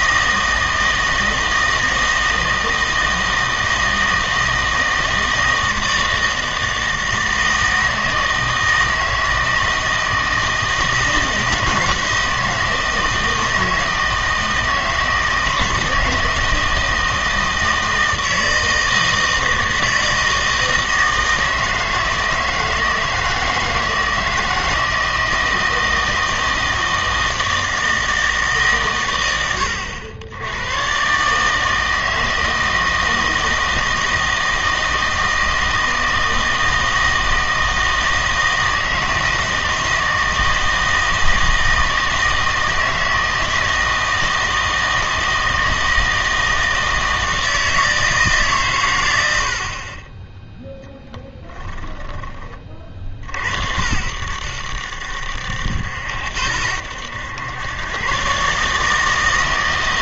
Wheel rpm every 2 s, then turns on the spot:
160, 160, 160, 160, 160, 160, 160, 160, 160, 160, 160, 160, 160, 160, 150, 110, 160, 160, 160, 160, 160, 160, 160, 160, 140, 0, 30, 80, 80, 140.
none